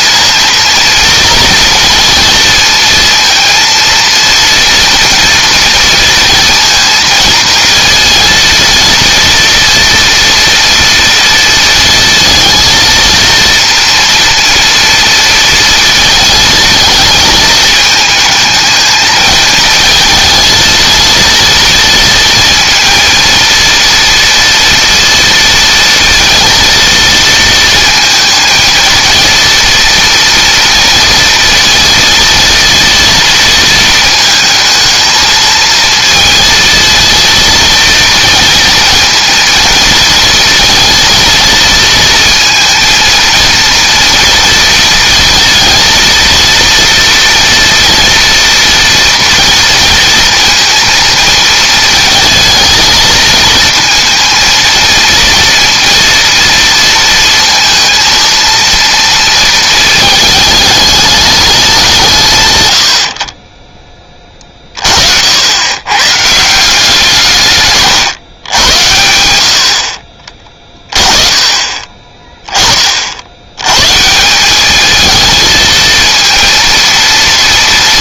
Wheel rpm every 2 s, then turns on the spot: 230, 230, 230, 230, 230, 230, 230, 230, 220, 220, 230, 230, 240, 230, 230, 230, 230, 220, 230, 230, 230, 220, 230, 230, 230, 230, 220, 230, 220, 230, 210, 90, 50, 170, 100, 20, 30, 210, 230.
none